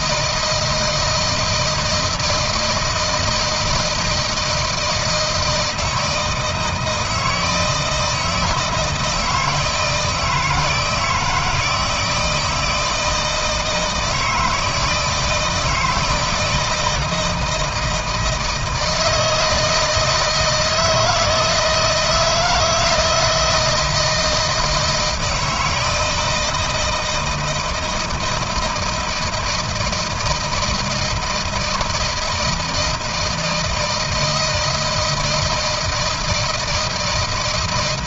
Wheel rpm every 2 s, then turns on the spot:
160, 160, 160, 160, 160, 160, 160, 160, 160, 160, 160, 170, 160, 160, 160, 160, 160, 160, 160.
none